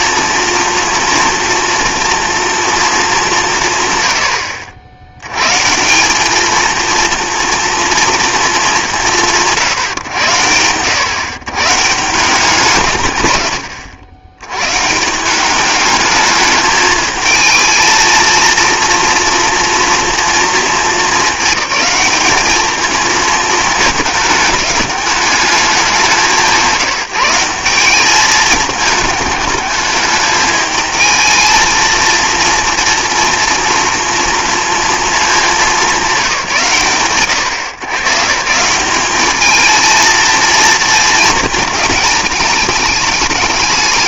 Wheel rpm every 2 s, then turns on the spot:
230, 230, 80, 220, 200, 100, 150, 140, 210, 230, 230, 220, 210, 190, 210, 220, 230, 230, 140, 170, 230, 210.
none